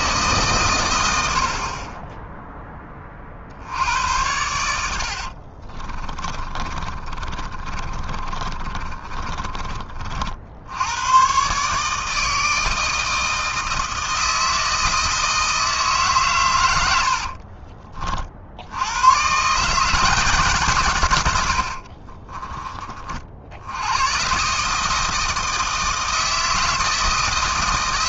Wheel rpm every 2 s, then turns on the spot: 130, 10, 90, 30, 30, 70, 160, 160, 120, 60, 150, 20, 140, 160.
6-10